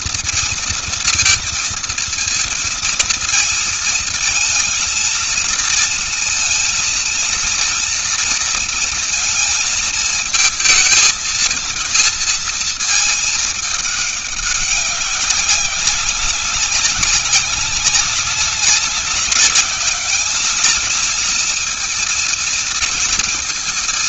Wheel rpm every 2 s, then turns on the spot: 230, 230, 230, 230, 230, 220, 220, 200, 190, 190, 210, 230.
none